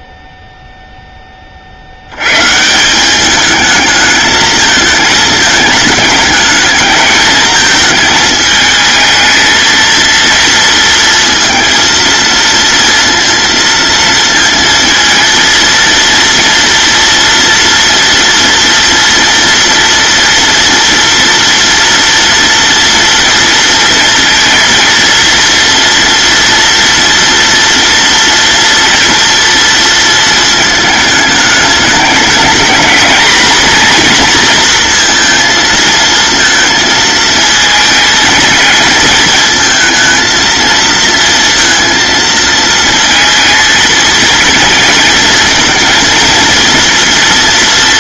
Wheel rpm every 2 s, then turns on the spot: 30, 210, 220, 220, 230, 230, 230, 230, 230, 230, 230, 230, 230, 230, 230, 210, 230, 230, 220, 220, 230, 230, 230, 230.
none